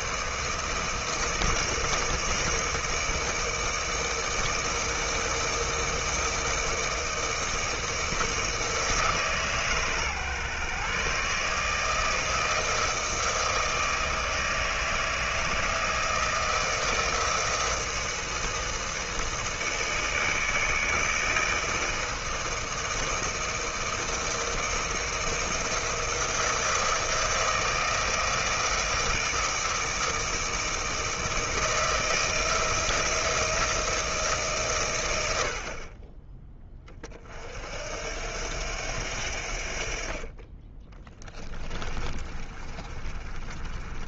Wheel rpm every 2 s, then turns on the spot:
170, 160, 160, 160, 160, 140, 160, 160, 160, 160, 160, 160, 170, 160, 160, 160, 170, 110, 30, 80, 30, 30.
40-44